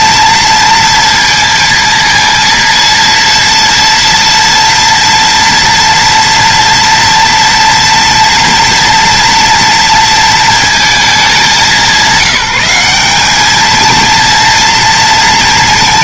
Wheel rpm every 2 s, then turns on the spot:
230, 230, 230, 230, 230, 220, 190, 230.
none